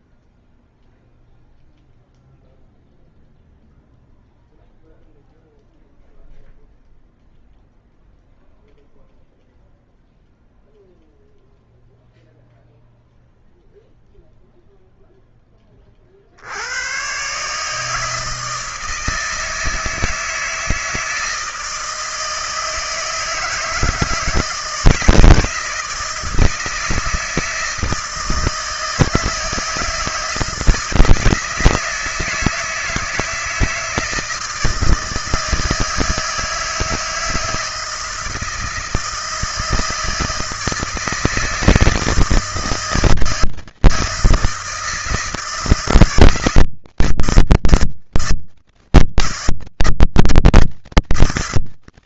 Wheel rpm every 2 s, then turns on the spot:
0, 0, 0, 0, 0, 0, 0, 0, 100, 160, 160, 160, 160, 160, 160, 160, 160, 160, 160, 160, 160, 160, 160, 160, 160, 160.
none